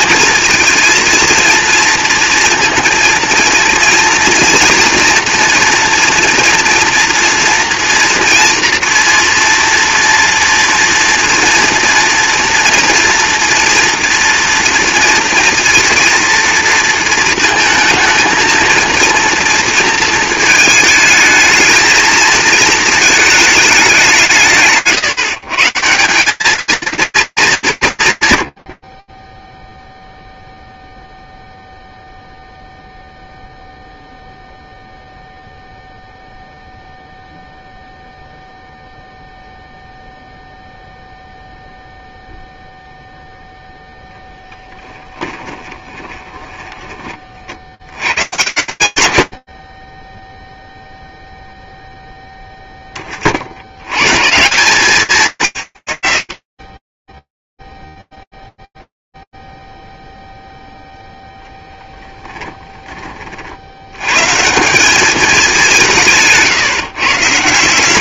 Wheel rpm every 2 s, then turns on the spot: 230, 230, 230, 230, 230, 230, 230, 230, 230, 230, 220, 230, 150, 220, 120, 0, 0, 0, 0, 0, 0, 0, 20, 120, 20, 0, 80, 170, 50, 0, 0, 20, 160, 160.
44-46 62-64